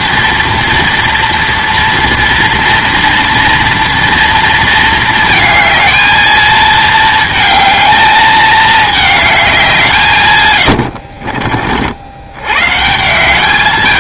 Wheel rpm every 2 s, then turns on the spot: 230, 230, 230, 220, 210, 90, 120.
10-12